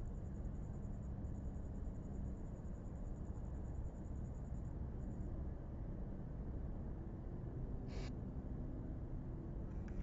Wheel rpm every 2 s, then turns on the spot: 0, 0, 0, 0, 0.
none